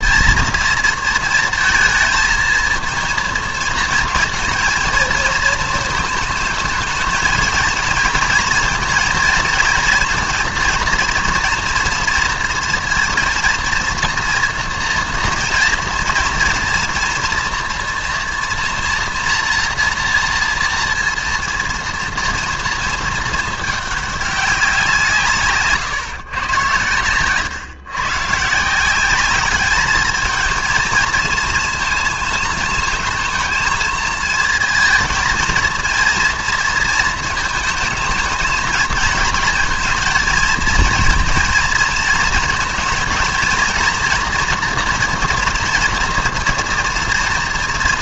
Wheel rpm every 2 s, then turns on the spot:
230, 230, 230, 220, 230, 230, 230, 230, 240, 240, 230, 230, 180, 110, 170, 230, 220, 230, 230, 220, 220, 220, 240, 240.
none